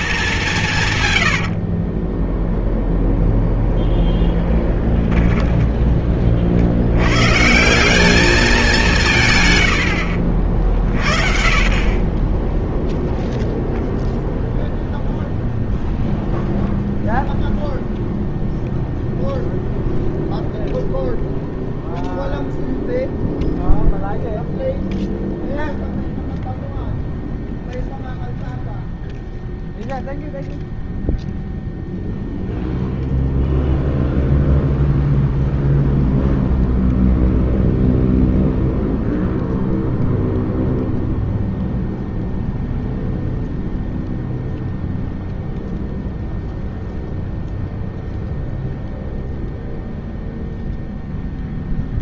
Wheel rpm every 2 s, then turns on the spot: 130, 0, 10, 90, 180, 50, 0, 0, 0, 0, 0, 0, 0, 0, 0, 0, 0, 0, 0, 0, 0, 0, 0, 0, 0, 0.
0-2